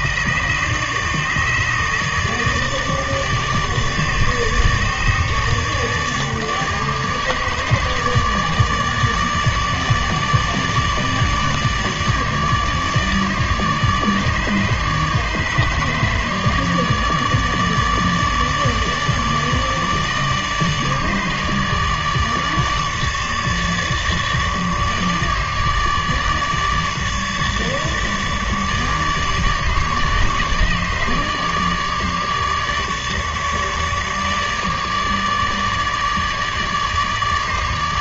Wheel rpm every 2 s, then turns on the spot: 150, 150, 150, 150, 150, 150, 150, 150, 150, 150, 150, 150, 150, 150, 150, 150, 150, 150, 150.
none